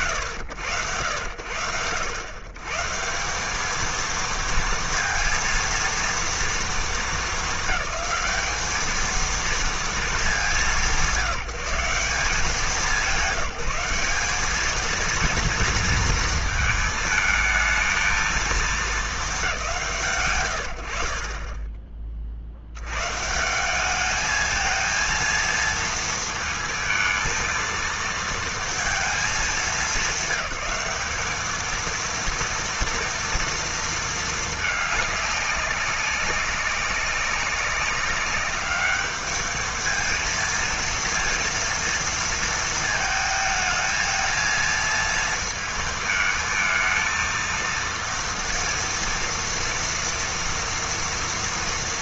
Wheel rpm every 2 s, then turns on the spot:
90, 190, 230, 210, 220, 180, 180, 230, 220, 220, 80, 110, 220, 220, 220, 200, 230, 210, 190, 210, 230, 220, 230, 230, 230, 230.
none